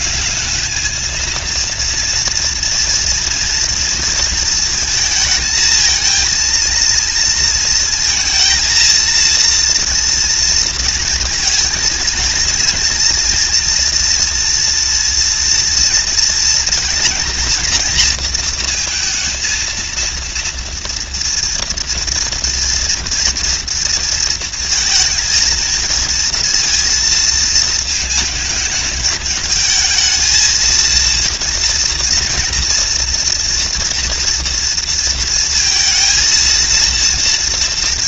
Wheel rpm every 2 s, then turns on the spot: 220, 230, 220, 230, 230, 230, 230, 240, 230, 230, 230, 230, 220, 220, 210, 230, 230, 230, 230.
none